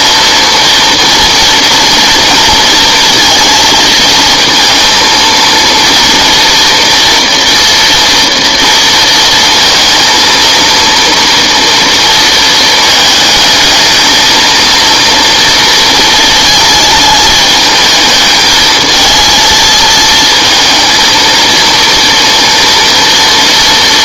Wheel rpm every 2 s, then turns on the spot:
230, 230, 230, 230, 230, 230, 220, 230, 220, 220, 230, 230.
none